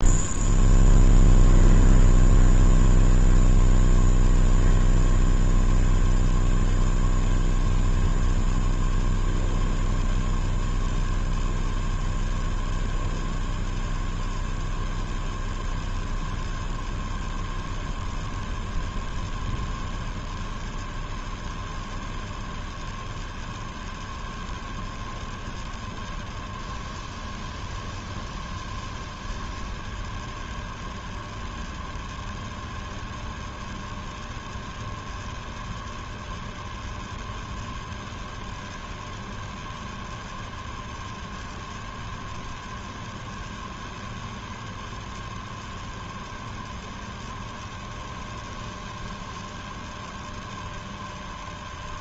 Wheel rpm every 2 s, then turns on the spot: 0, 0, 0, 0, 0, 0, 0, 0, 0, 0, 0, 0, 0, 0, 0, 0, 0, 0, 0, 0, 0, 0, 0, 0, 0, 0.
none